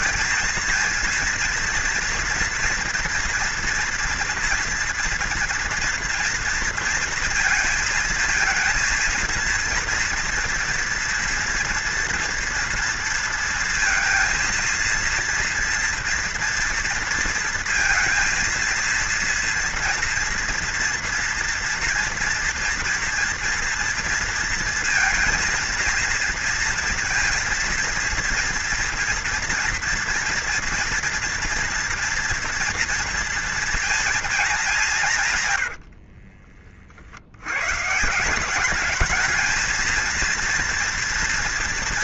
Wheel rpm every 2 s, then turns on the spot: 230, 230, 230, 230, 230, 230, 230, 230, 230, 230, 230, 230, 220, 230, 230, 230, 230, 160, 60, 220, 230.
none